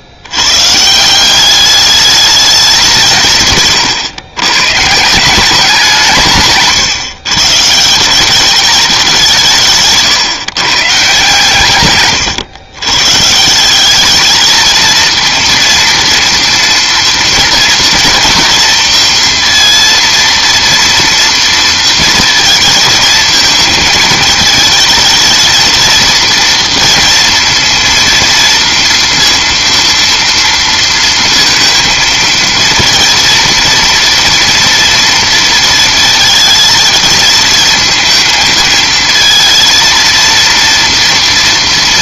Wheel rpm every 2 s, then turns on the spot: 130, 200, 130, 140, 210, 140, 120, 220, 230, 230, 230, 220, 220, 230, 230, 230, 230, 230, 220, 220, 230.
none